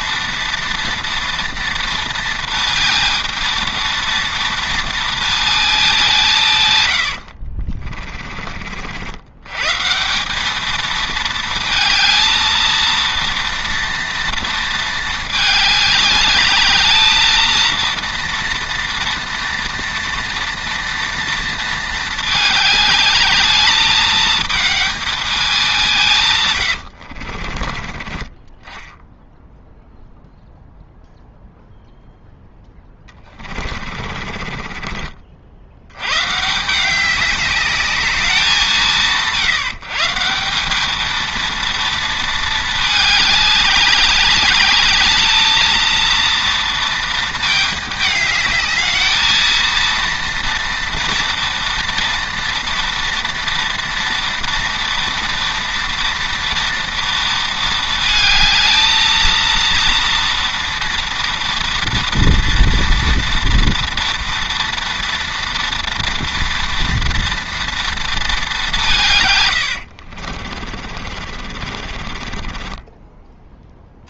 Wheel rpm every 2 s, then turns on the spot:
230, 230, 230, 110, 60, 220, 230, 220, 220, 230, 230, 210, 220, 90, 10, 0, 10, 30, 180, 170, 210, 210, 210, 230, 220, 230, 240, 230, 230, 220, 230, 230, 230, 230, 180, 40, 20.
26-28 32-36 70-74